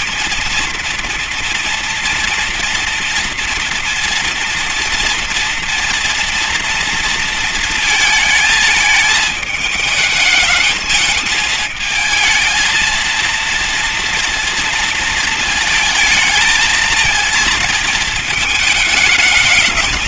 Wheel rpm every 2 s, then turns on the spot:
230, 230, 240, 230, 220, 220, 220, 230, 220, 220.
none